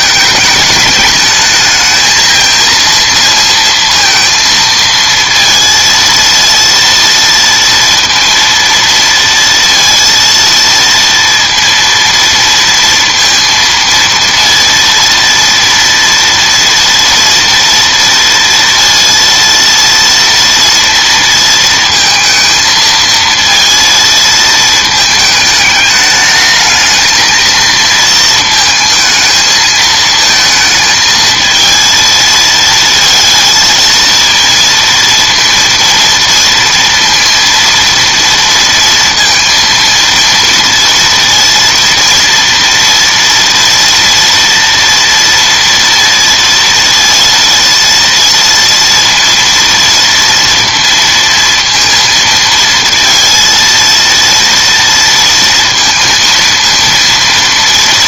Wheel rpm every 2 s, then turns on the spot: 210, 230, 230, 230, 230, 230, 230, 230, 230, 230, 230, 220, 220, 220, 220, 220, 230, 230, 230, 230, 230, 230, 230, 230, 230, 230, 230, 230, 230.
none